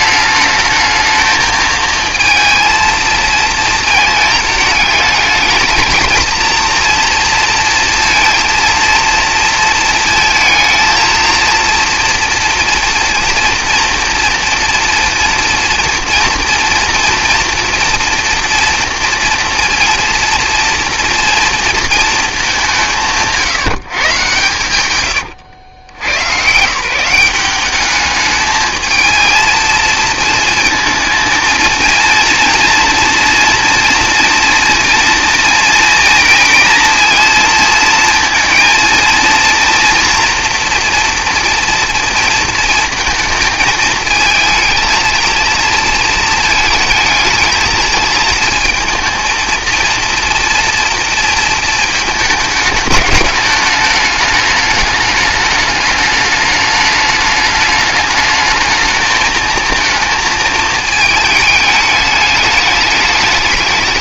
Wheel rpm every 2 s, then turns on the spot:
220, 230, 220, 230, 230, 220, 230, 230, 230, 230, 240, 190, 120, 150, 220, 230, 230, 230, 230, 230, 240, 230, 230, 220, 230, 230, 210, 210, 210, 220, 220, 210.
none